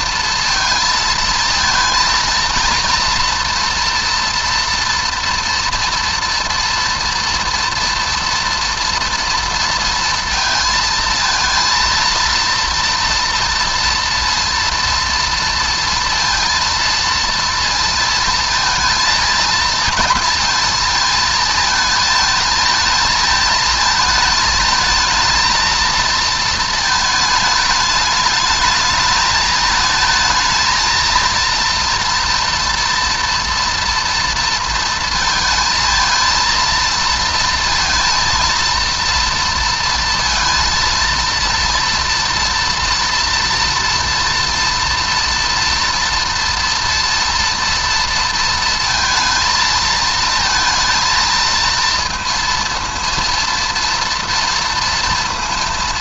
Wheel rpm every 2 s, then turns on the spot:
230, 230, 230, 230, 230, 230, 230, 230, 230, 230, 230, 220, 220, 220, 210, 220, 230, 230, 220, 230, 230, 230, 230, 240, 230, 220, 230, 230.
none